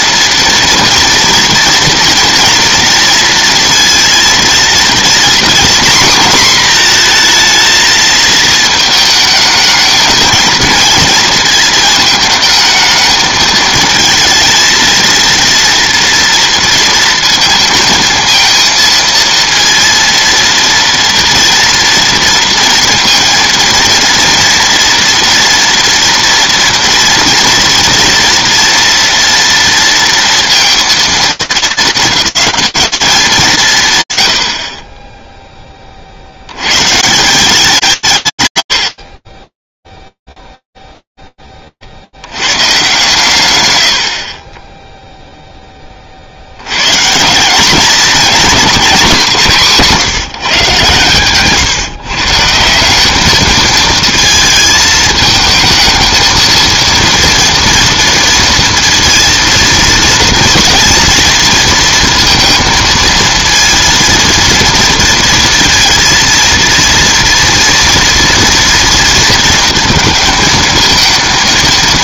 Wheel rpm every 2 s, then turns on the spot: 230, 230, 240, 240, 220, 230, 220, 220, 230, 230, 230, 230, 230, 230, 230, 230, 200, 20, 150, 50, 0, 120, 20, 110, 210, 150, 180, 220, 230, 230, 230, 230, 230, 230, 230, 220.
none